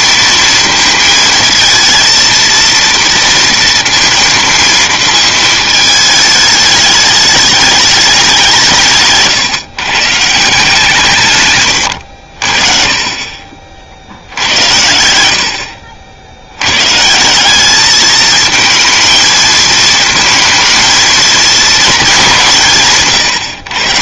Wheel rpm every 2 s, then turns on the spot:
230, 230, 230, 210, 170, 160, 50, 90, 100, 220, 230, 160.
none